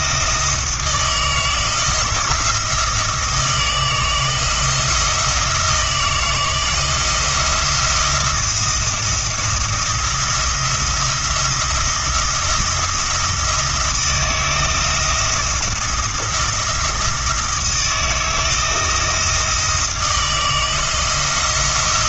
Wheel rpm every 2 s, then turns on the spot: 160, 170, 170, 170, 170, 170, 170, 160, 170, 160, 160.
none